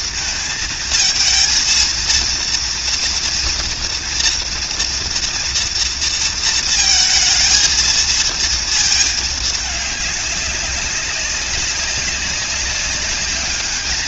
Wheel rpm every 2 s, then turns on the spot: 230, 230, 230, 220, 220, 190, 200.
none